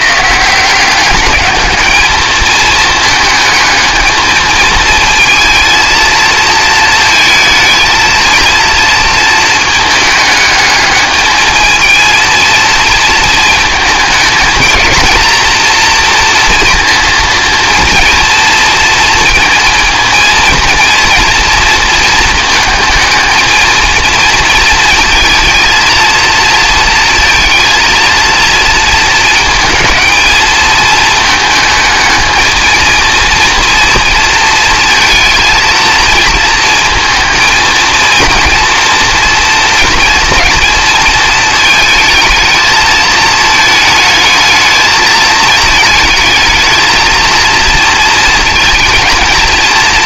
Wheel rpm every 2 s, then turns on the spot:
180, 220, 220, 220, 230, 210, 230, 220, 230, 230, 230, 220, 230, 230, 230, 220, 220, 230, 230, 230, 220, 220, 220, 220, 230.
none